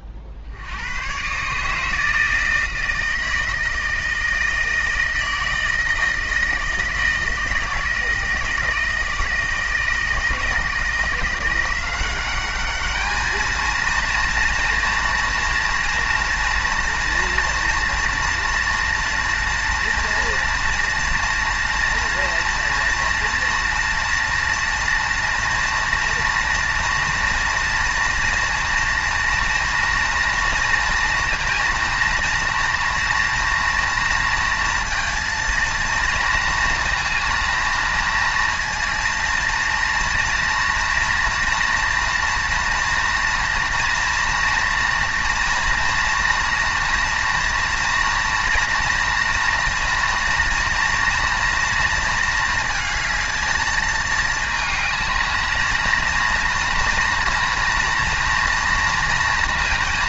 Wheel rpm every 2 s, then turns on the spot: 60, 160, 160, 160, 160, 160, 200, 230, 230, 240, 240, 230, 230, 230, 230, 230, 230, 230, 230, 230, 230, 230, 230, 230, 240, 230, 230, 220, 230, 230.
none